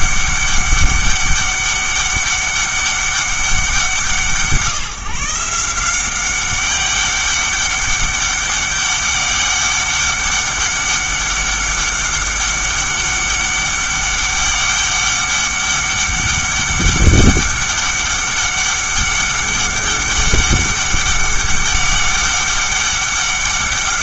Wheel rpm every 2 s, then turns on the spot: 200, 200, 160, 200, 200, 200, 200, 200, 200, 200, 200, 200.
none